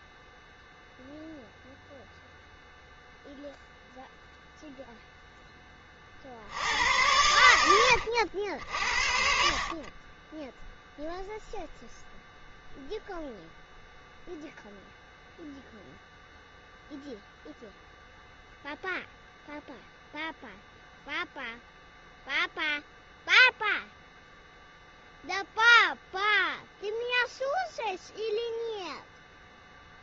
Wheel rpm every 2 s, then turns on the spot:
0, 0, 0, 90, 70, 0, 0, 0, 0, 0, 0, 0, 0, 0, 0.
none